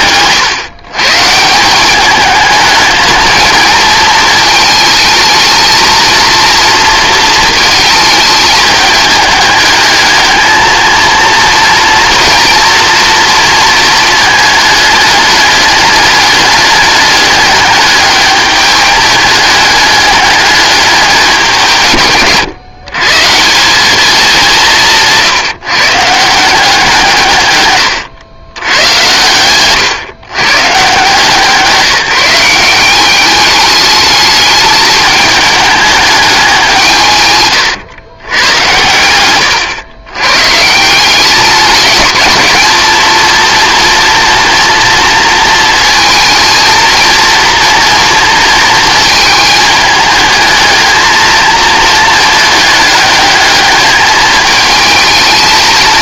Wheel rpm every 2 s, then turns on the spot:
140, 210, 220, 230, 210, 220, 230, 210, 210, 210, 200, 130, 180, 170, 100, 140, 190, 210, 160, 100, 160, 220, 230, 220, 230, 220, 220, 220.
none